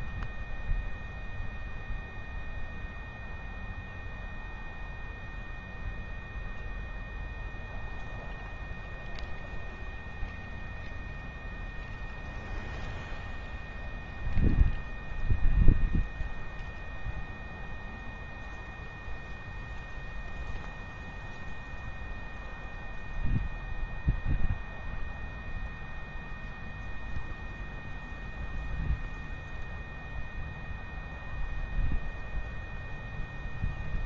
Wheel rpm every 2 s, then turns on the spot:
0, 0, 0, 0, 0, 0, 0, 0, 0, 0, 0, 0, 0, 0, 0, 0, 0.
none